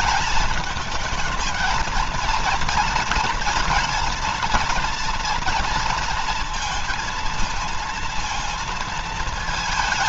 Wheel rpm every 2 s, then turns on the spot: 210, 230, 230, 230, 230.
none